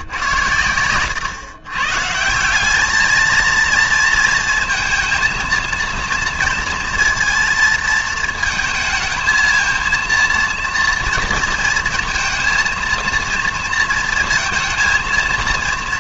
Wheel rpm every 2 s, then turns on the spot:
100, 190, 230, 230, 220, 230, 230, 230.
none